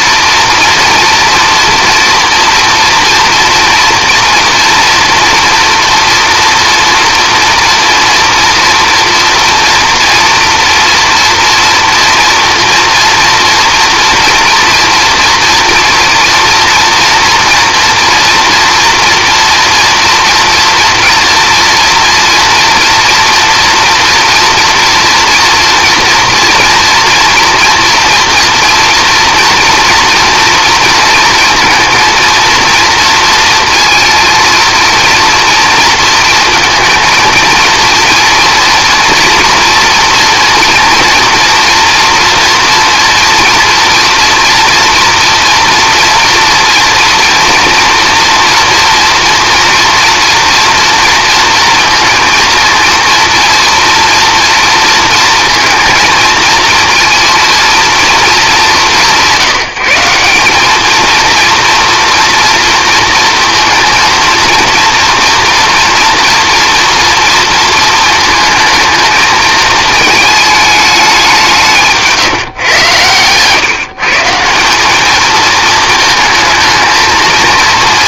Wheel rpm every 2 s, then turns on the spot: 230, 230, 240, 230, 230, 230, 230, 230, 230, 230, 230, 230, 230, 230, 230, 230, 230, 230, 220, 230, 230, 230, 240, 230, 230, 230, 230, 230, 230, 180, 220, 230, 230, 230, 220, 210, 120, 200, 220.
none